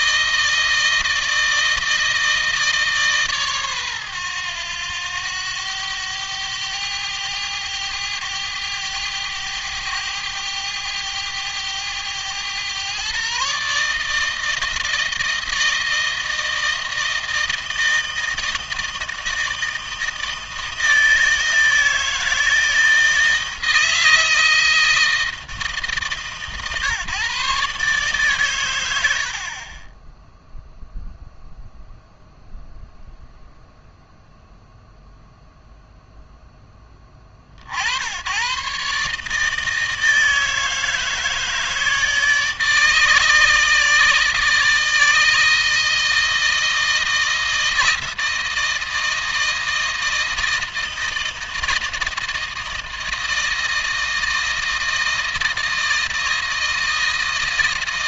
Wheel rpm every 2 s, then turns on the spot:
160, 150, 100, 100, 100, 100, 120, 160, 160, 160, 160, 160, 160, 130, 100, 0, 0, 0, 10, 130, 160, 150, 160, 160, 160, 160, 160, 160, 160.
none